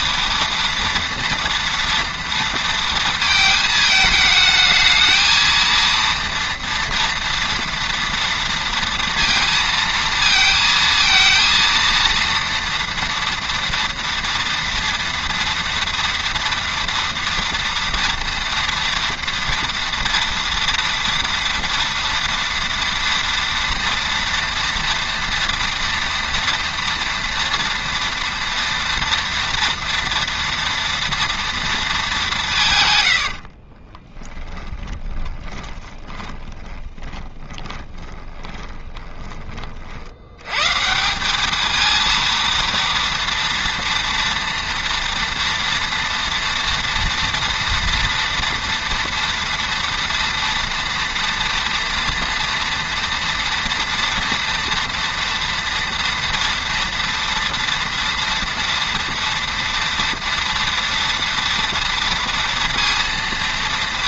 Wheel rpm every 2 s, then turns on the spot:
230, 230, 220, 230, 230, 230, 230, 230, 230, 230, 230, 230, 230, 230, 230, 230, 160, 20, 20, 20, 120, 230, 230, 230, 230, 230, 240, 230, 230, 230, 230, 230.
34-40